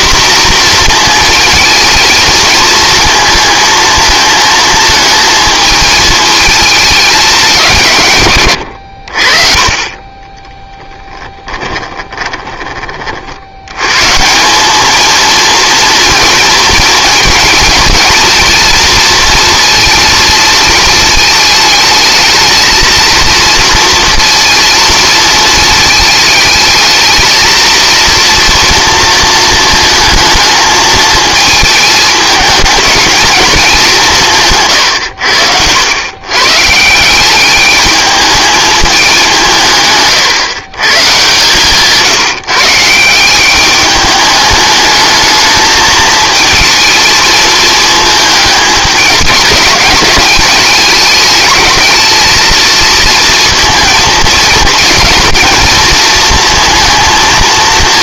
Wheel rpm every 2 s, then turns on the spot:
230, 230, 230, 220, 90, 10, 30, 200, 230, 230, 220, 230, 230, 220, 230, 220, 220, 140, 140, 210, 120, 150, 210, 220, 210, 210, 220, 220, 230.
10-12